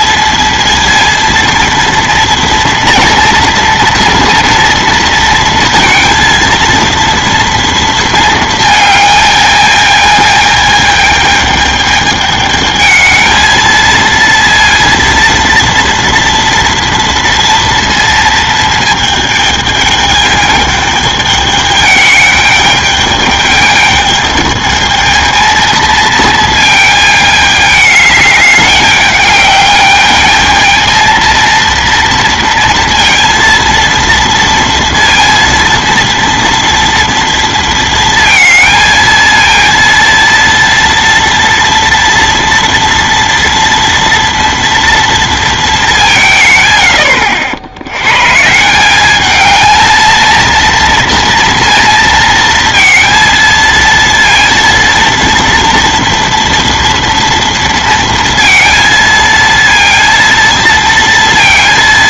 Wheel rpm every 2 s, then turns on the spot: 230, 240, 230, 230, 220, 220, 210, 230, 230, 230, 210, 210, 210, 220, 210, 220, 230, 230, 240, 230, 230, 230, 230, 130, 170, 230, 230, 230, 230, 230, 230.
none